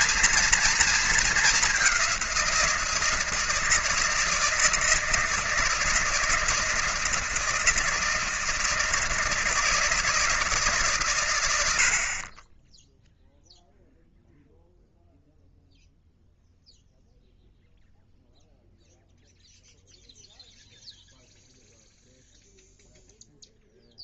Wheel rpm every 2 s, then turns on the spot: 230, 170, 160, 160, 160, 140, 10, 0, 0, 0, 0, 0.
none